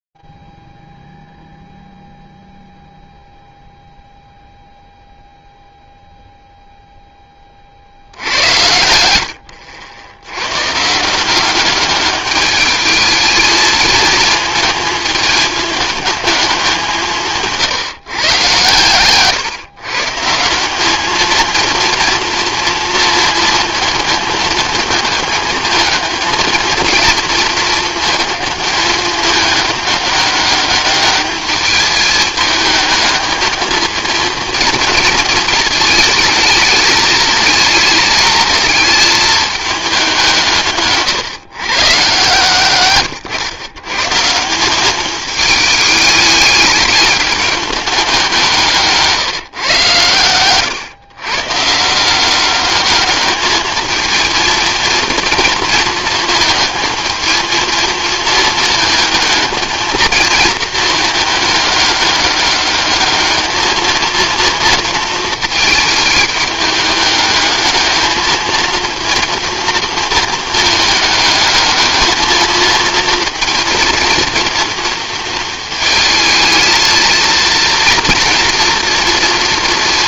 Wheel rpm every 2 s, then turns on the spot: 0, 0, 0, 0, 80, 110, 210, 220, 200, 130, 170, 230, 220, 220, 210, 200, 210, 230, 220, 220, 170, 140, 180, 210, 160, 120, 200, 230, 220, 220, 220, 200, 230, 210, 230, 220, 220, 230, 220, 230.
none